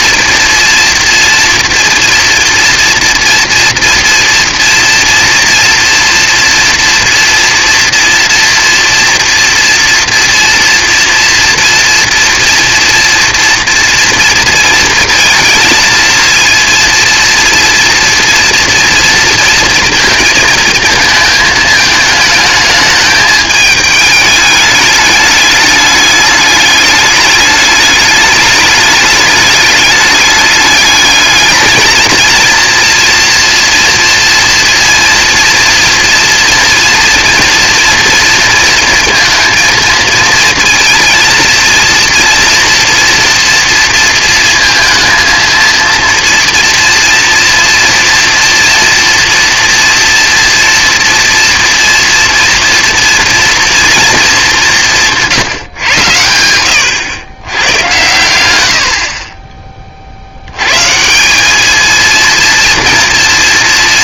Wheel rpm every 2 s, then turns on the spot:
230, 240, 230, 230, 230, 230, 230, 230, 230, 230, 220, 220, 210, 210, 210, 210, 230, 230, 230, 230, 230, 240, 230, 230, 240, 230, 240, 200, 100, 100, 110, 230.
none